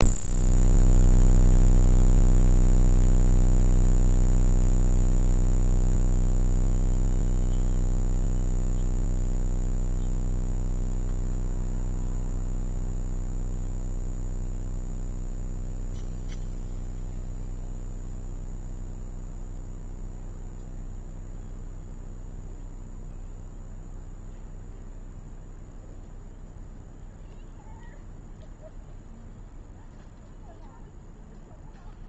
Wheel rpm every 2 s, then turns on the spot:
0, 0, 0, 0, 0, 0, 0, 0, 0, 0, 0, 0, 0, 0, 0, 0.
none